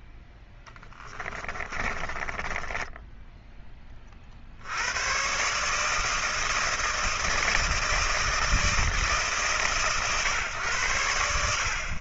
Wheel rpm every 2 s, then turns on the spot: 10, 20, 70, 160, 160, 120.
0-4